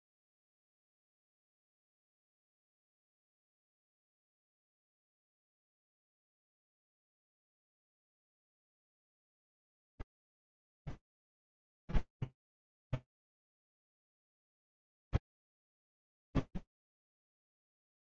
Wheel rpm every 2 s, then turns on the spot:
0, 0, 0, 0, 0, 0, 0, 0, 0.
none